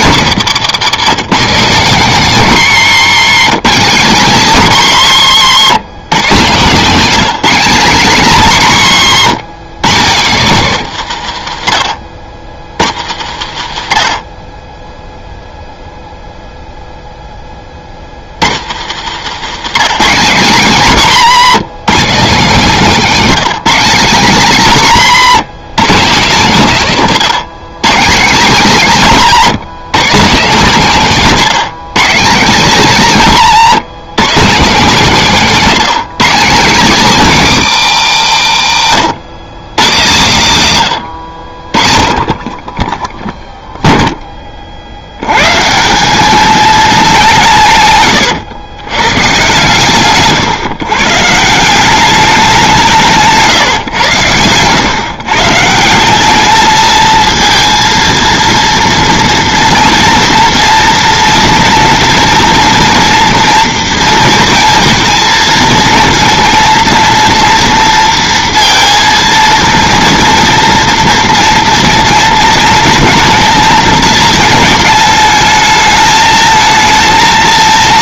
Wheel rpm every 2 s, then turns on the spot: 180, 180, 190, 180, 180, 170, 90, 20, 0, 110, 180, 200, 170, 160, 190, 200, 190, 200, 210, 110, 120, 20, 40, 210, 110, 130, 180, 120, 220, 230, 230, 240, 230, 230, 230, 230, 230, 220, 220.
none